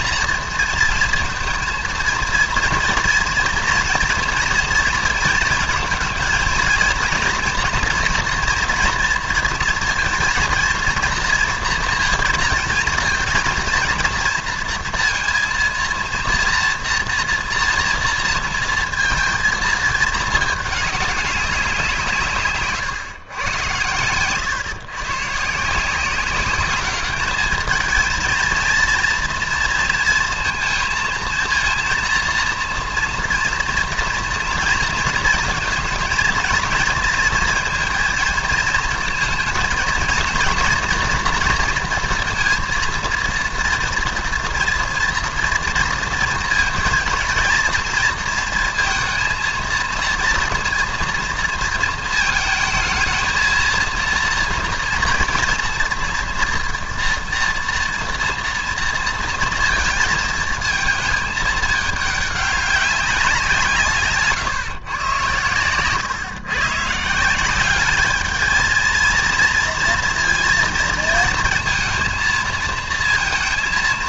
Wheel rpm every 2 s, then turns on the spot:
230, 230, 230, 230, 230, 230, 230, 230, 230, 230, 210, 130, 130, 200, 230, 220, 230, 230, 230, 230, 230, 230, 230, 230, 230, 230, 220, 230, 230, 230, 230, 200, 140, 130, 220, 230, 230.
22-24